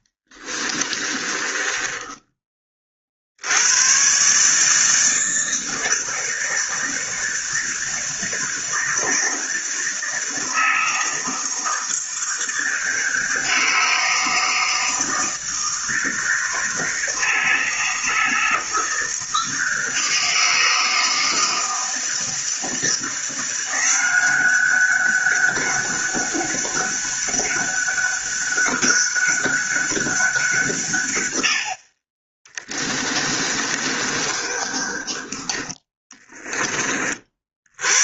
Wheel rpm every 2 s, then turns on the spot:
30, 40, 160, 160, 160, 160, 160, 160, 160, 160, 160, 160, 190, 200, 200, 150, 20, 40, 40.
0-2 32-36